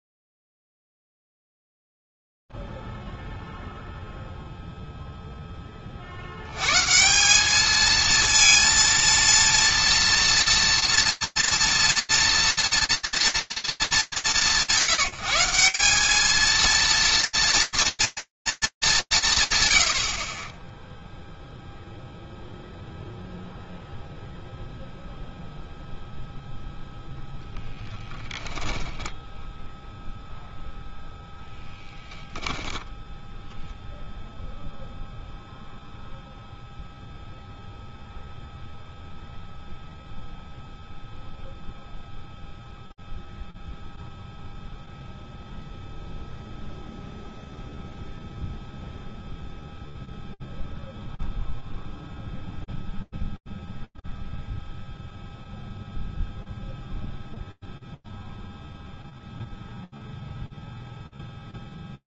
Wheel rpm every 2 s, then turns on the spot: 0, 0, 0, 100, 230, 230, 230, 170, 220, 230, 40, 0, 0, 10, 10, 0, 0, 0, 0, 0, 0, 0, 0, 0, 0, 0, 0, 0, 0, 0, 0.
28-30